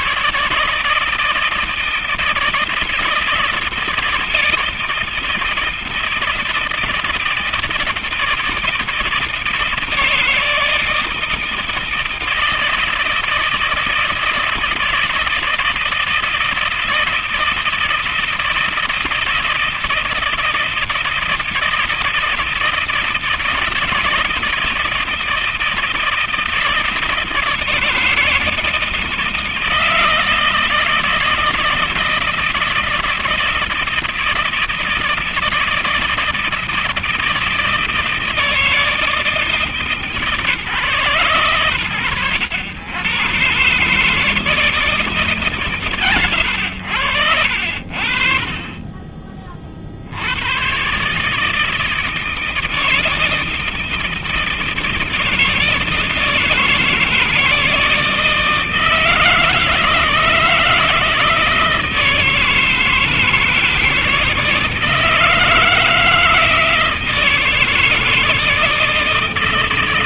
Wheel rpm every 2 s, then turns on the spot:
150, 160, 160, 160, 160, 160, 160, 160, 160, 160, 160, 160, 160, 160, 170, 160, 160, 160, 160, 160, 150, 110, 160, 90, 20, 110, 160, 160, 160, 160, 160, 160, 160, 160, 160.
none